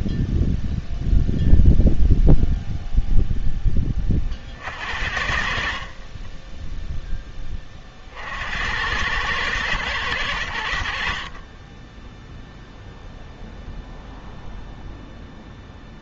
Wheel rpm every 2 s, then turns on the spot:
0, 0, 60, 0, 90, 60, 0, 0.
none